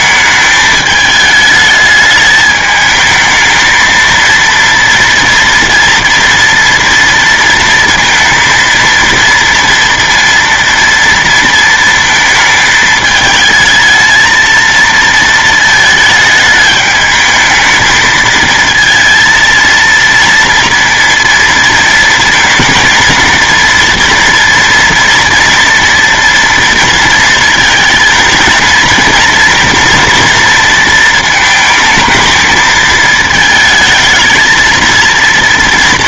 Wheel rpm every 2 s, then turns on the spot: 220, 210, 230, 230, 230, 230, 220, 230, 220, 220, 230, 230, 230, 240, 230, 230, 220, 230.
none